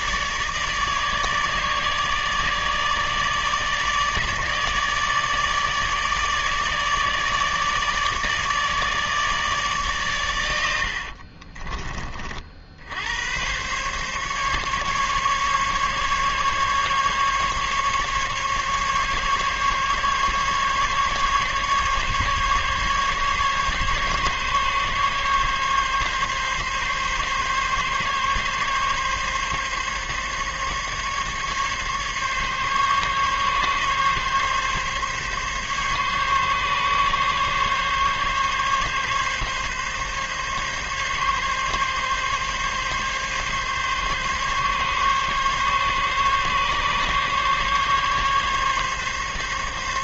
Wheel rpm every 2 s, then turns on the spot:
150, 150, 150, 150, 150, 70, 80, 140, 140, 140, 150, 140, 140, 140, 140, 140, 140, 140, 140, 140, 140, 140, 140, 140, 140.
10-12